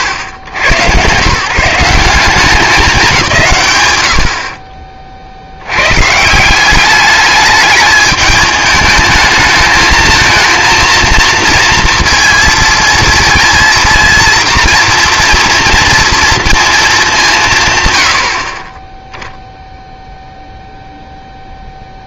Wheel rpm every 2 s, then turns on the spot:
120, 180, 50, 180, 210, 230, 230, 230, 230, 30, 0.
none